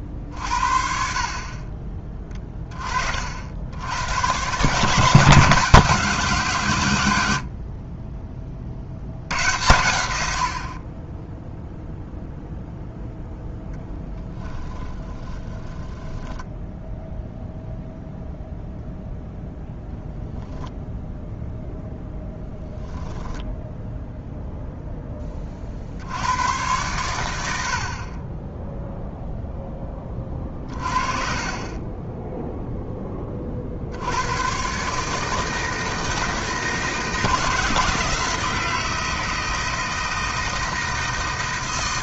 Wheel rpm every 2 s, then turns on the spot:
40, 60, 170, 80, 90, 0, 0, 30, 0, 0, 0, 10, 10, 100, 0, 40, 10, 150, 160, 160, 160.
14-16